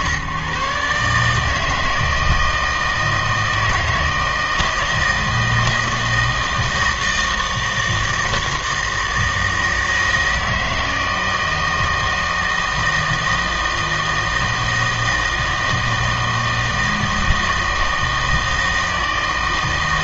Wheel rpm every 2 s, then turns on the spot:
140, 160, 160, 160, 160, 160, 160, 160, 160, 160.
none